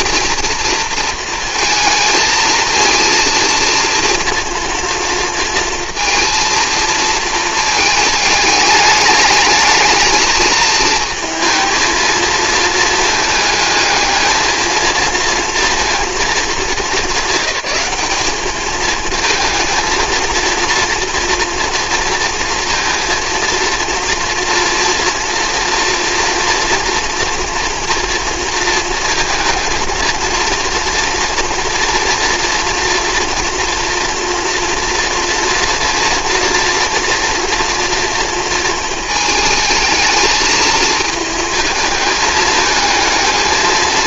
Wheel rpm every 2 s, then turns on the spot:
230, 220, 230, 230, 210, 220, 230, 230, 210, 210, 230, 230, 230, 230, 230, 230, 230, 230, 230, 220, 220, 220.
none